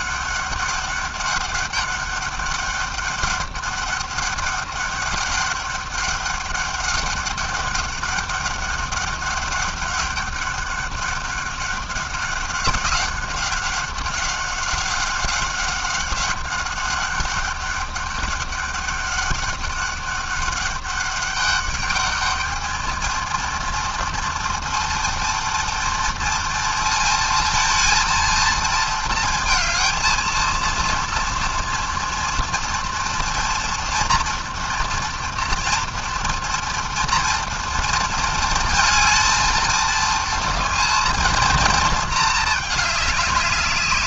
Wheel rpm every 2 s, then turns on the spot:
200, 200, 200, 200, 200, 200, 190, 190, 200, 200, 200, 230, 230, 230, 220, 230, 230, 240, 230, 220, 230, 200.
none